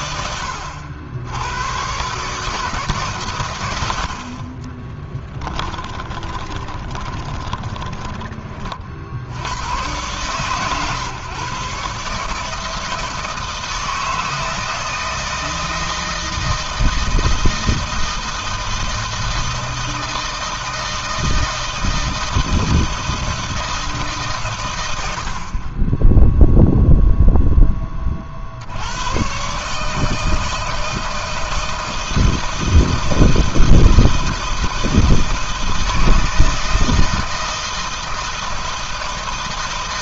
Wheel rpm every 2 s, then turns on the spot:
100, 150, 50, 20, 30, 120, 150, 160, 160, 160, 160, 160, 130, 0, 70, 160, 160, 160, 160, 160.
4-8